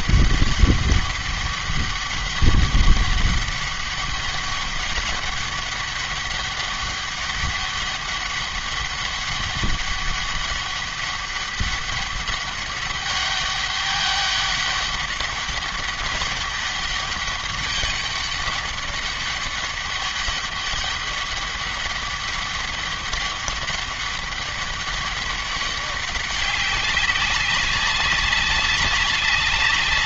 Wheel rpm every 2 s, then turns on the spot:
200, 200, 200, 200, 200, 200, 200, 200, 200, 200, 200, 200, 200, 200, 190.
none